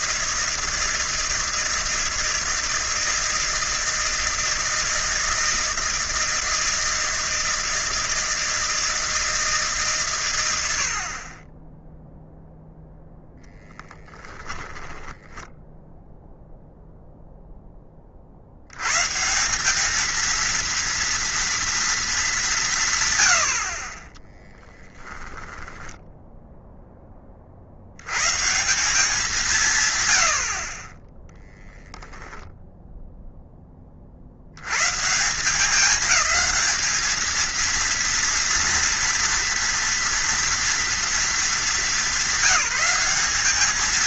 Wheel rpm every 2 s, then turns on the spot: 160, 160, 160, 160, 160, 80, 0, 10, 0, 80, 230, 160, 10, 0, 180, 40, 0, 100, 220, 230, 230, 200.
14-16 24-26